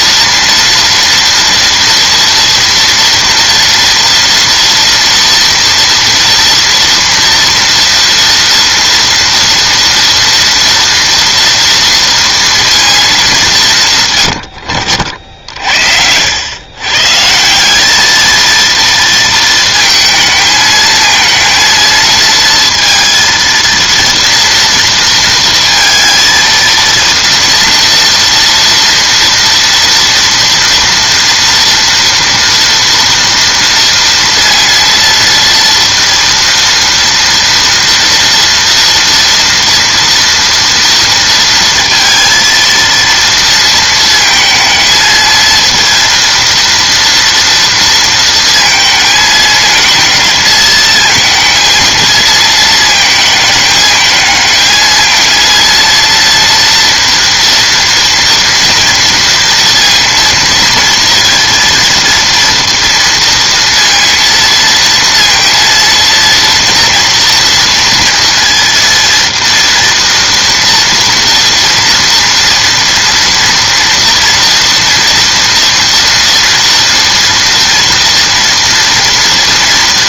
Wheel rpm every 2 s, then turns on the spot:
230, 230, 230, 230, 230, 230, 220, 60, 110, 230, 220, 230, 230, 230, 230, 230, 230, 230, 230, 230, 230, 230, 220, 230, 220, 220, 220, 220, 230, 230, 230, 230, 230, 230, 230, 230, 230, 240, 230, 230.
none